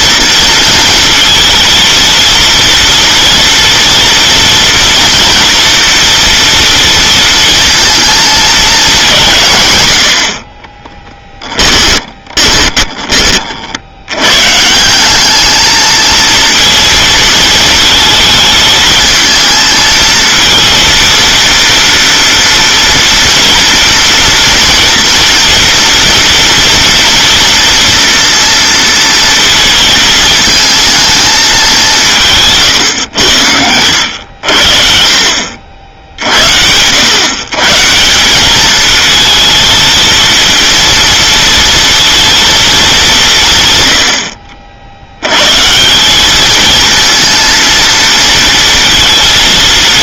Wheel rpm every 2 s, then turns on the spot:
230, 230, 230, 230, 220, 20, 20, 140, 230, 220, 230, 230, 230, 230, 230, 220, 150, 60, 80, 210, 230, 220, 60, 220, 230.
10-14